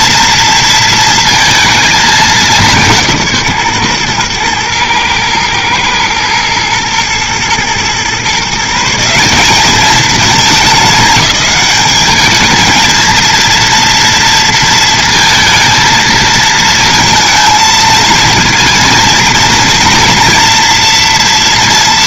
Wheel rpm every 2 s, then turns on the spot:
230, 200, 120, 110, 150, 210, 220, 230, 230, 230, 230.
none